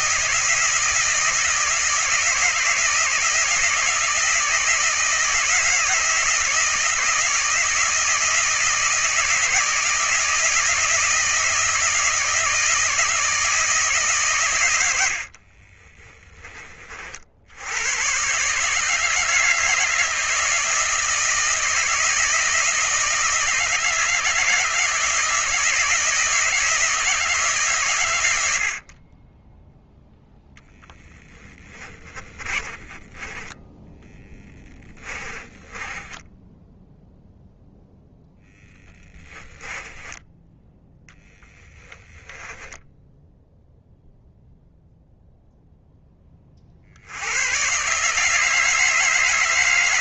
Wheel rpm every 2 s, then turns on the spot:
160, 160, 160, 160, 160, 160, 160, 90, 40, 150, 160, 160, 160, 160, 50, 0, 20, 20, 0, 10, 10, 10, 0, 60, 160.
32-36 38-40 42-44